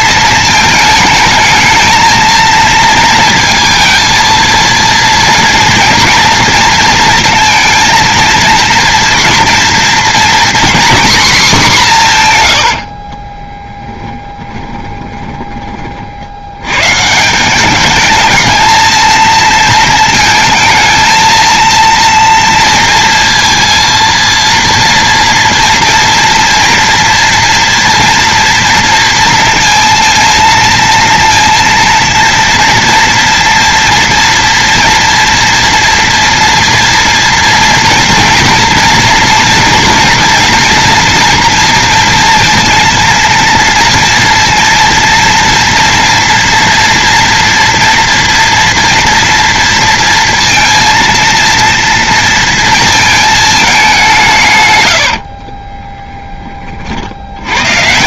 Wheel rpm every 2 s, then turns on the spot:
220, 230, 230, 230, 230, 250, 110, 10, 90, 220, 220, 230, 230, 230, 230, 230, 230, 230, 230, 230, 240, 230, 230, 230, 240, 230, 230, 130, 30.
12-16